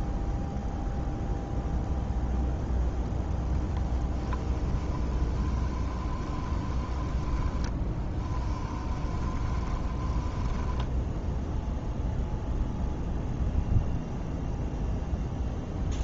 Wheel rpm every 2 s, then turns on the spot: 0, 0, 20, 20, 10, 10, 0, 0.
4-12